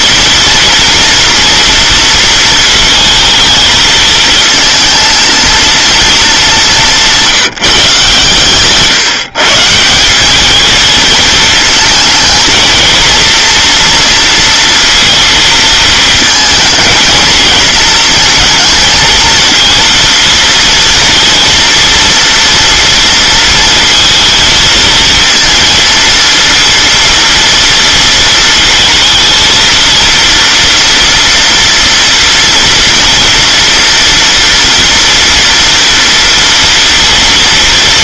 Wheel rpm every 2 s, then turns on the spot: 230, 220, 220, 200, 140, 210, 230, 230, 220, 230, 230, 230, 230, 230, 220, 230, 230, 230, 230.
none